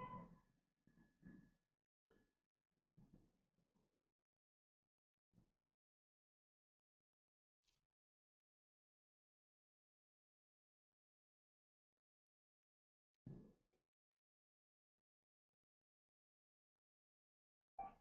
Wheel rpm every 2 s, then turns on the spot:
0, 0, 0, 0, 0, 0, 0, 0, 0.
none